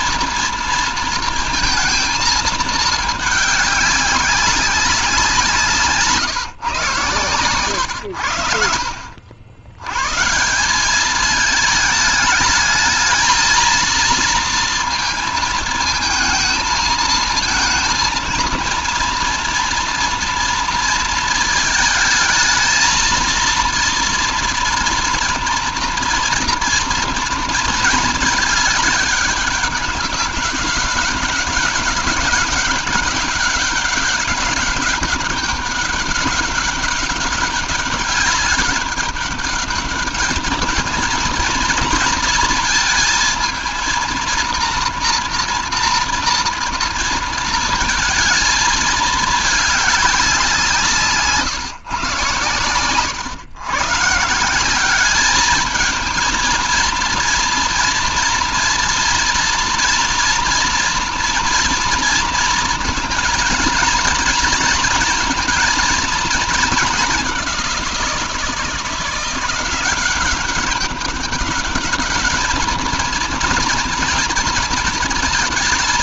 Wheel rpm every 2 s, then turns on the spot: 230, 210, 190, 140, 70, 200, 220, 230, 230, 230, 230, 230, 240, 240, 200, 190, 200, 200, 190, 200, 220, 230, 230, 230, 220, 150, 110, 200, 230, 230, 240, 230, 230, 200, 170, 200, 230, 220.
none